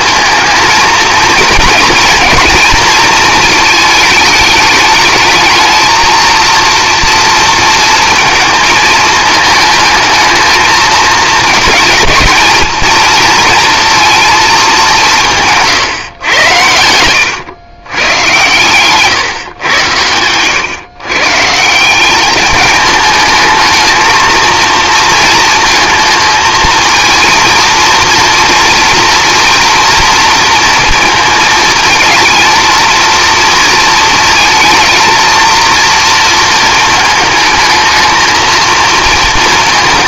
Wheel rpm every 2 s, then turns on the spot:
230, 230, 210, 230, 220, 220, 220, 210, 90, 120, 120, 210, 230, 230, 230, 230, 230, 230, 220, 220.
16-18